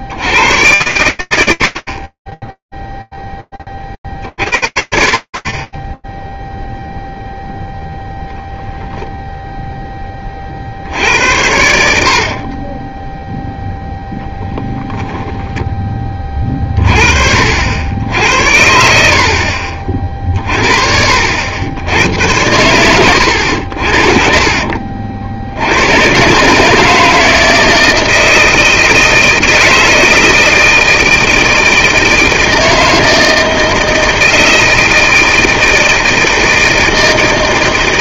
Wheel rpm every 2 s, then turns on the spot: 100, 0, 40, 0, 0, 60, 10, 10, 50, 70, 60, 90, 70, 160, 160, 160, 160, 160, 160.
14-16